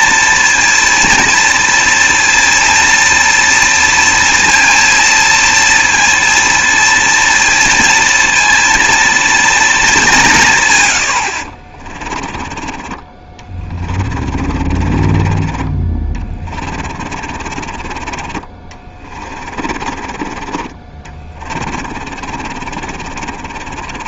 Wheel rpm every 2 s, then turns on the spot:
230, 230, 230, 230, 230, 130, 30, 40, 30, 30, 30, 30.
12-20 22-24